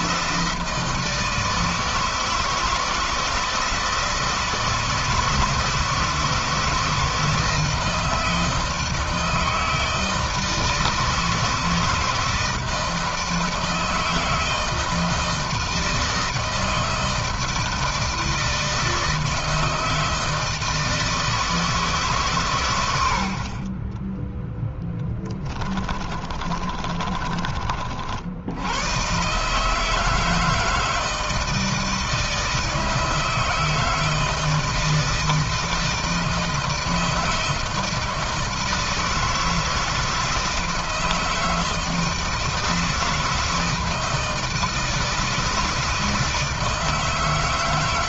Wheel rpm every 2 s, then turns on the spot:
160, 160, 160, 160, 160, 160, 160, 160, 160, 160, 160, 60, 20, 30, 130, 160, 160, 160, 160, 160, 160, 160, 160, 160.
22-28